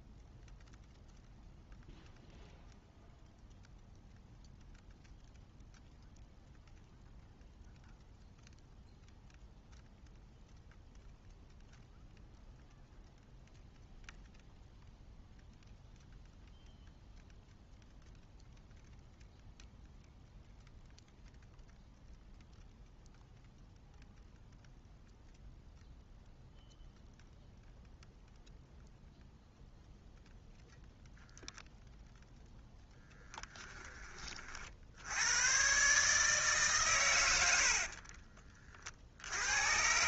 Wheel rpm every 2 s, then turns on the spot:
0, 0, 0, 0, 0, 0, 0, 0, 0, 0, 0, 0, 0, 0, 0, 0, 10, 70, 120, 60.
none